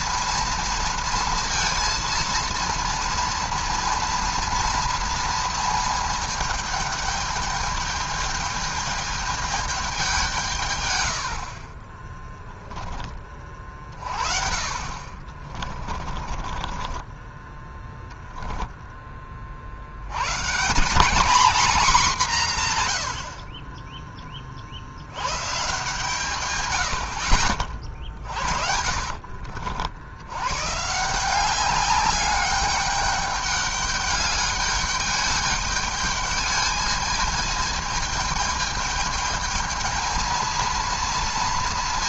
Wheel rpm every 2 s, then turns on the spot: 230, 230, 230, 220, 210, 150, 10, 40, 30, 10, 140, 170, 40, 120, 40, 110, 200, 210, 210, 210, 220.
12-14 16-20